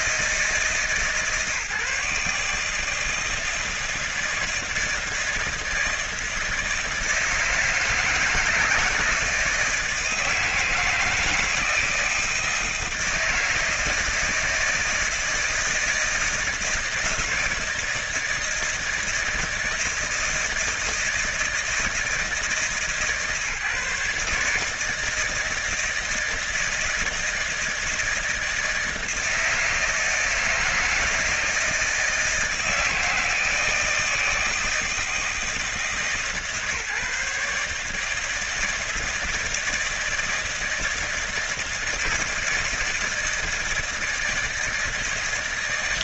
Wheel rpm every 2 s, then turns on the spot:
160, 160, 160, 160, 170, 160, 160, 160, 160, 160, 160, 160, 160, 160, 160, 170, 160, 160, 140, 160, 160, 160, 160.
none